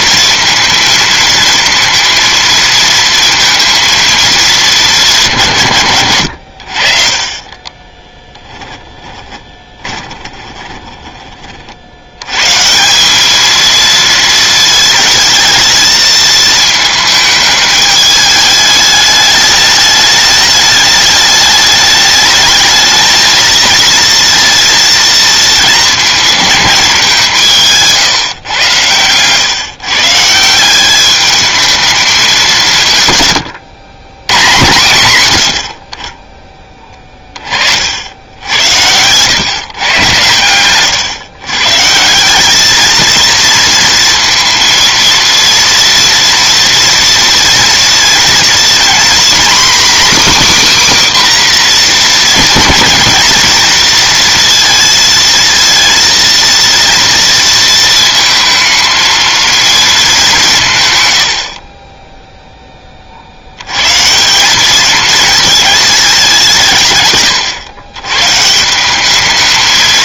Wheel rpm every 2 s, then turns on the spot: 230, 230, 200, 50, 20, 20, 150, 220, 220, 210, 210, 220, 230, 200, 120, 190, 160, 120, 20, 90, 120, 210, 230, 230, 240, 280, 230, 230, 230, 220, 140, 20, 200, 160, 170.
8-12